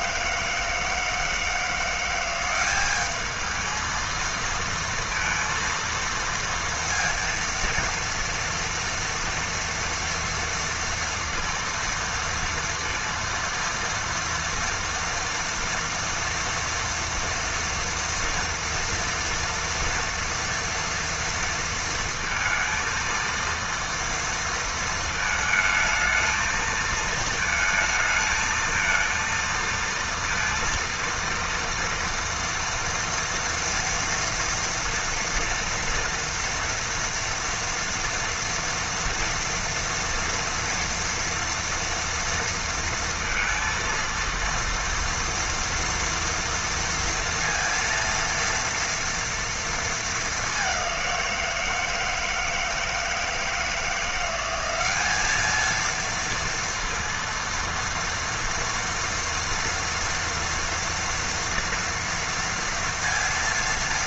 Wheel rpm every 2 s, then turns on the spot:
160, 200, 230, 230, 230, 230, 230, 230, 230, 230, 230, 230, 230, 220, 230, 230, 230, 230, 230, 230, 230, 230, 230, 230, 230, 200, 160, 190, 230, 230, 230, 230.
none